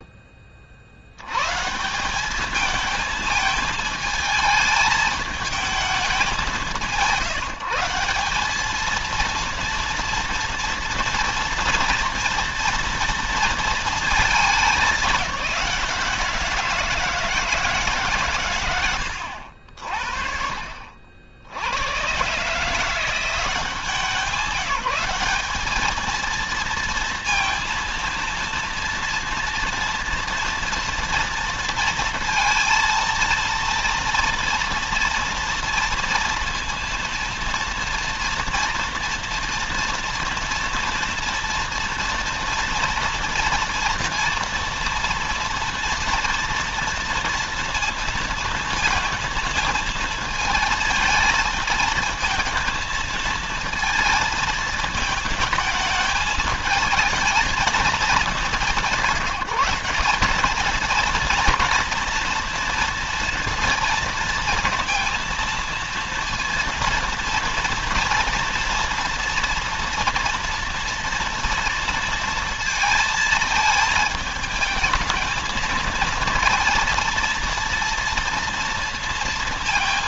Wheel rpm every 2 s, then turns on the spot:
80, 220, 220, 170, 230, 230, 230, 200, 160, 80, 60, 170, 190, 230, 240, 230, 230, 230, 230, 240, 240, 230, 230, 230, 220, 220, 230, 220, 220, 190, 230, 230, 230, 230, 230, 230, 220, 220, 230, 230.
18-20